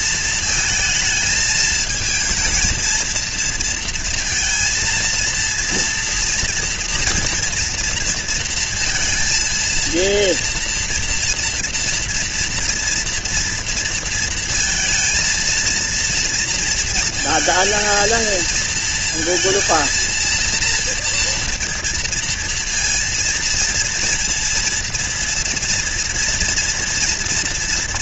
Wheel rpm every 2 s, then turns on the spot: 220, 220, 230, 230, 230, 230, 230, 230, 230, 230, 230, 230, 230, 230.
none